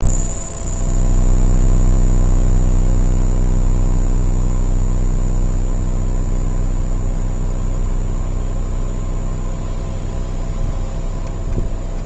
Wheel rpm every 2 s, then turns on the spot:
10, 10, 10, 10, 10, 10.
0-10